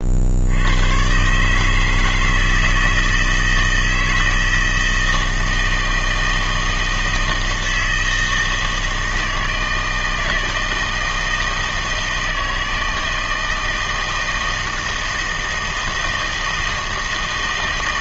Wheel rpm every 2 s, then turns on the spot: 80, 160, 160, 160, 160, 160, 160, 160, 160.
none